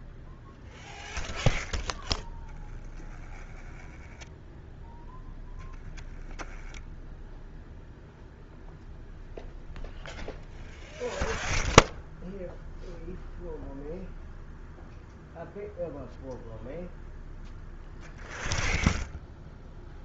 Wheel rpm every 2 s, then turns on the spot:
0, 10, 0, 0, 0, 0, 0, 0, 0, 0.
none